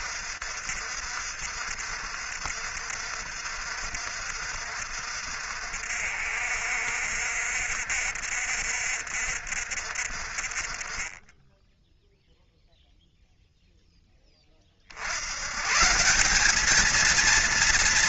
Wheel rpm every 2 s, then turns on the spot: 60, 60, 60, 60, 60, 50, 0, 20, 180.
none